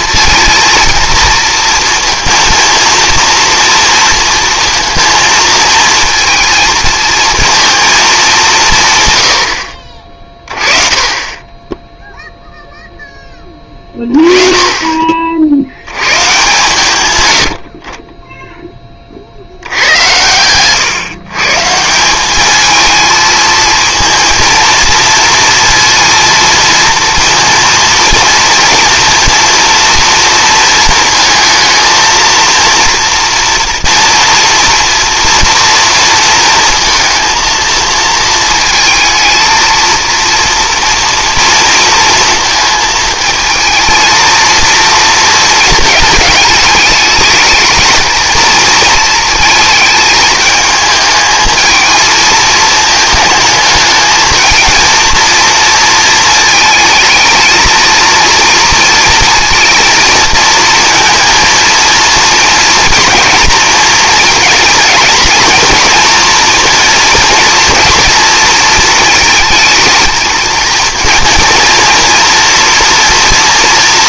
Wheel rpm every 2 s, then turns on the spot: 230, 230, 230, 220, 150, 20, 0, 30, 140, 10, 120, 210, 230, 230, 230, 230, 230, 240, 230, 220, 230, 220, 230, 210, 230, 220, 220, 220, 220, 230, 230, 230, 220, 230, 230, 230, 240.
none